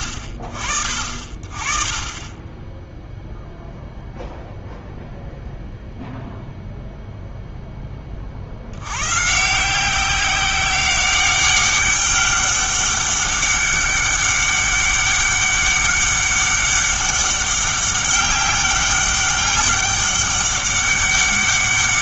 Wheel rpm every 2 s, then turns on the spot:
40, 10, 0, 0, 90, 190, 200, 200, 200, 200, 200.
none